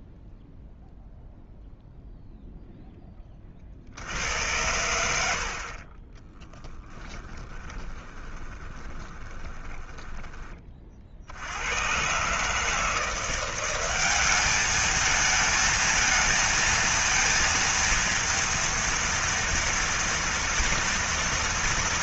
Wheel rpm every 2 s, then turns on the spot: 0, 0, 70, 30, 20, 10, 120, 190, 220, 230, 230.
8-12